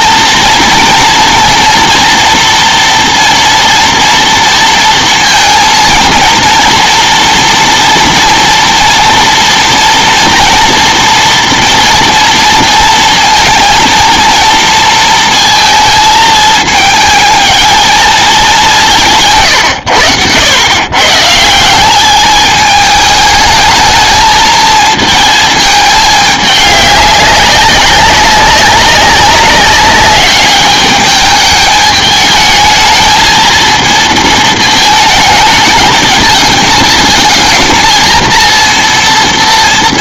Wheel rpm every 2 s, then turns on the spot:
240, 230, 230, 230, 230, 230, 230, 230, 220, 180, 110, 210, 230, 200, 190, 200, 220, 220, 220, 230.
none